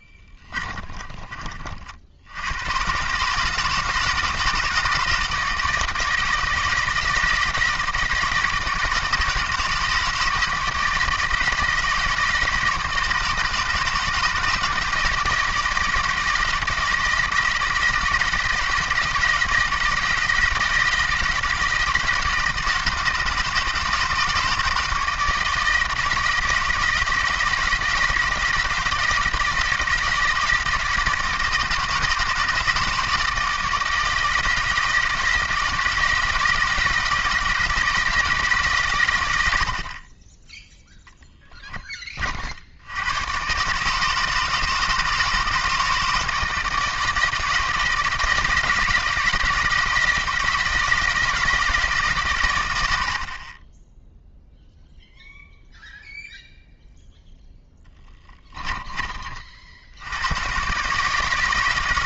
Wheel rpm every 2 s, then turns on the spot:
30, 110, 160, 160, 160, 160, 160, 160, 160, 160, 160, 160, 160, 160, 160, 160, 160, 160, 160, 140, 10, 70, 160, 160, 160, 160, 90, 0, 0, 20, 130.
0-2